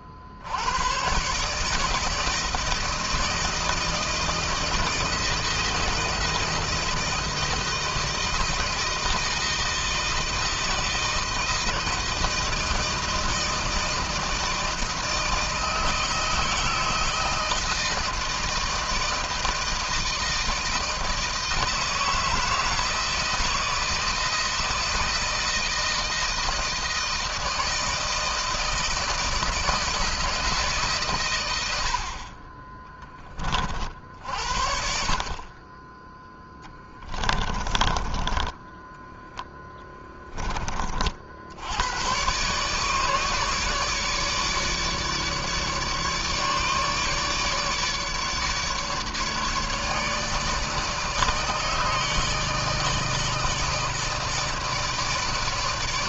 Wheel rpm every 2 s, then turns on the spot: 70, 160, 160, 160, 160, 160, 160, 160, 160, 160, 160, 160, 160, 160, 160, 160, 40, 60, 10, 10, 20, 130, 150, 150, 150, 150, 160, 160.
38-40